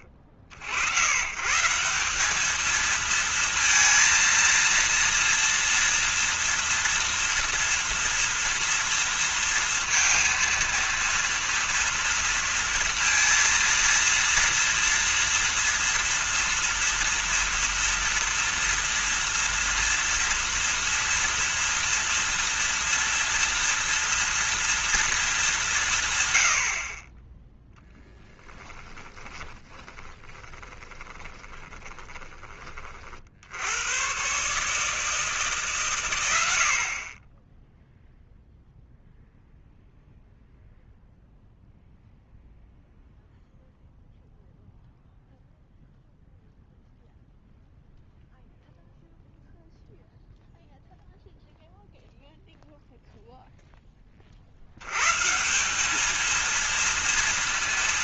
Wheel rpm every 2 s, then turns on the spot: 50, 210, 230, 230, 230, 230, 230, 230, 230, 230, 230, 230, 240, 80, 10, 20, 30, 140, 60, 0, 0, 0, 0, 0, 0, 0, 0, 70, 230.
28-32